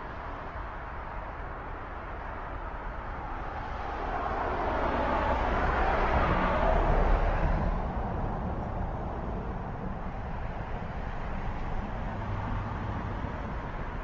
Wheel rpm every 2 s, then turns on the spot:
0, 0, 0, 0, 0, 0, 0.
none